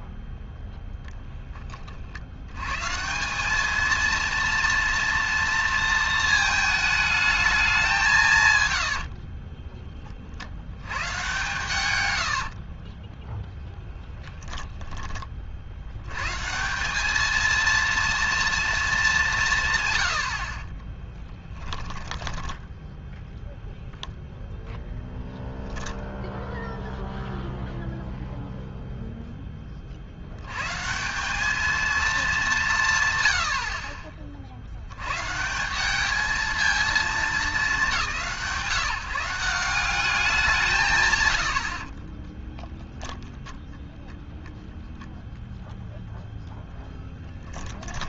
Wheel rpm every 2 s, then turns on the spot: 0, 110, 230, 220, 130, 70, 50, 10, 170, 230, 50, 20, 0, 0, 0, 100, 190, 80, 220, 150, 160, 10, 0, 0.
8-10 12-16 22-24 42-44